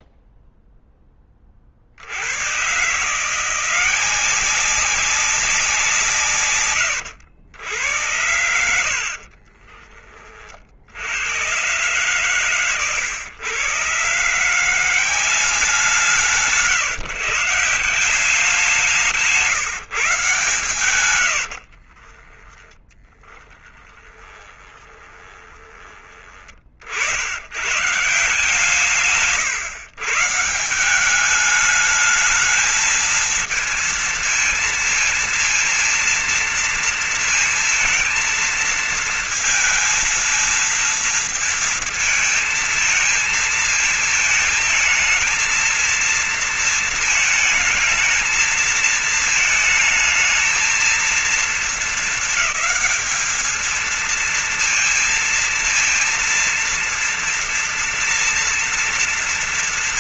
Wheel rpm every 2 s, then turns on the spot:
0, 80, 180, 140, 80, 40, 120, 140, 180, 180, 150, 40, 20, 30, 140, 150, 210, 220, 230, 230, 230, 230, 220, 230, 220, 220, 220, 220, 230, 230.
8-10 22-26